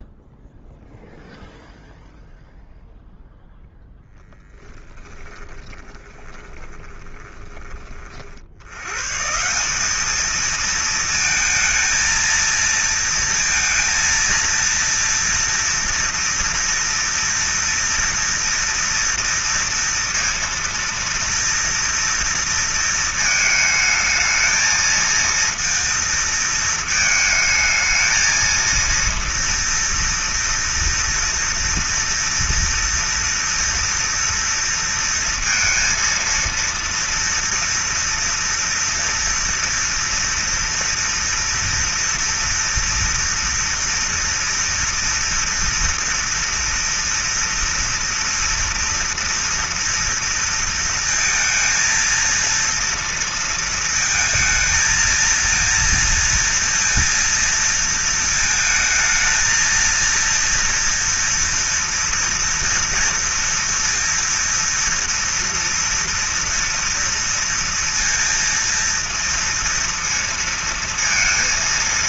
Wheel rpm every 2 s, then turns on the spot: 0, 0, 0, 10, 40, 210, 230, 230, 230, 230, 230, 230, 220, 230, 220, 230, 230, 230, 230, 230, 230, 230, 230, 230, 230, 230, 230, 220, 230, 220, 230, 230, 230, 230, 230, 230.
6-8